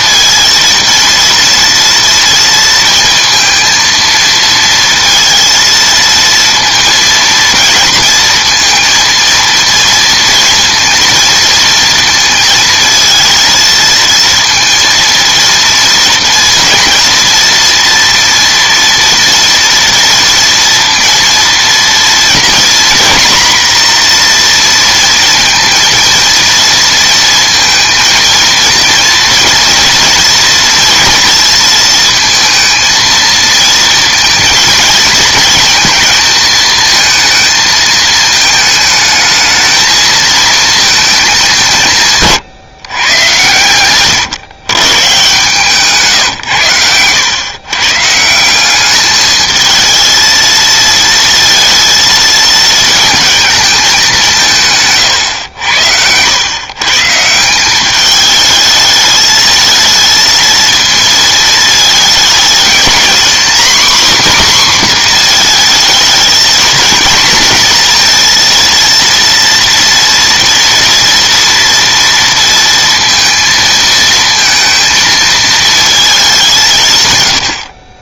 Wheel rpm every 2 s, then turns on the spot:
230, 230, 230, 230, 230, 230, 220, 230, 230, 230, 230, 230, 230, 230, 230, 230, 220, 230, 220, 220, 220, 120, 130, 100, 190, 220, 220, 140, 130, 210, 220, 220, 250, 230, 230, 230, 230, 220, 160.
54-56